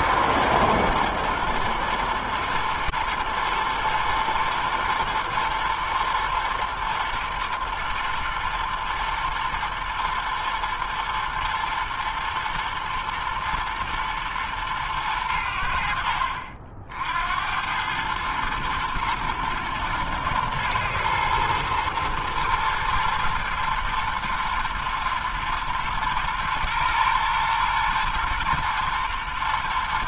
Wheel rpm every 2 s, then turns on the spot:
110, 110, 110, 120, 110, 110, 110, 110, 60, 110, 110, 120, 120, 110, 120.
none